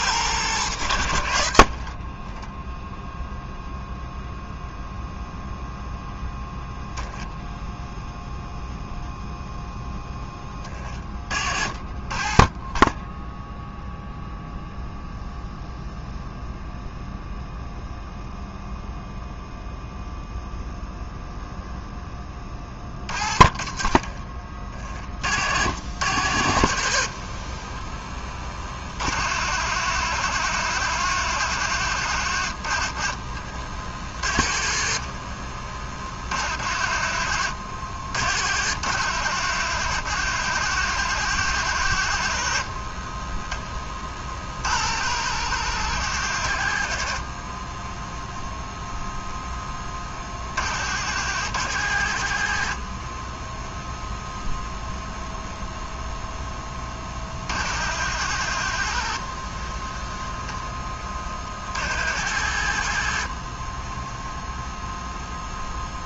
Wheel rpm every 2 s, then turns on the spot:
100, 0, 0, 0, 0, 30, 10, 0, 0, 0, 0, 30, 40, 50, 50, 90, 50, 40, 50, 80, 100, 40, 70, 50, 0, 70, 30, 0, 20, 70, 30, 60, 0.
26-28 34-36 42-44 58-60